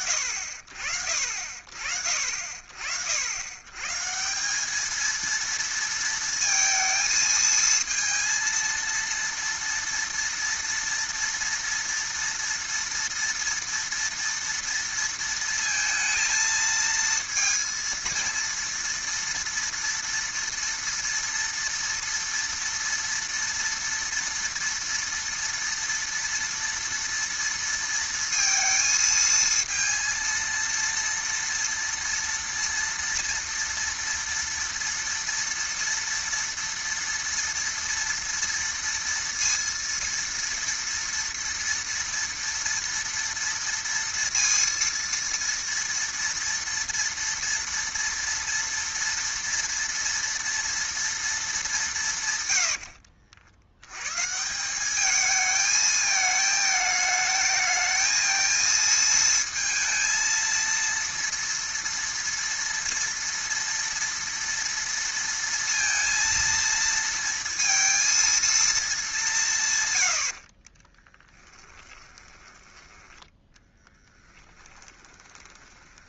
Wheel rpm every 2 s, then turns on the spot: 70, 80, 220, 220, 230, 230, 230, 230, 230, 230, 230, 230, 230, 230, 230, 230, 230, 230, 230, 230, 230, 230, 230, 230, 230, 230, 80, 200, 220, 230, 230, 230, 230, 230, 210, 20, 10, 10.
52-54 70-76